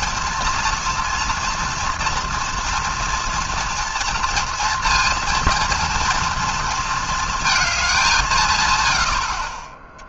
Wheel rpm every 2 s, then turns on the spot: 230, 230, 230, 230, 110.
none